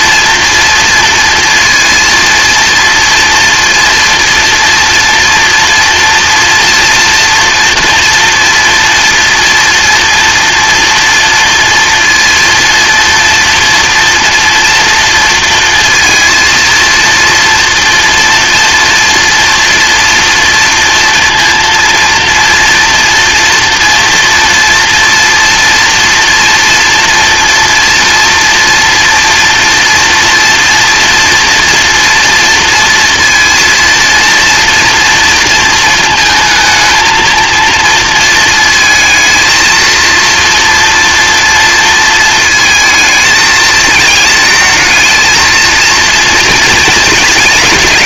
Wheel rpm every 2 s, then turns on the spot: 230, 230, 230, 240, 230, 240, 240, 230, 230, 230, 230, 230, 230, 240, 230, 230, 230, 230, 220, 220, 230, 220, 220, 230.
none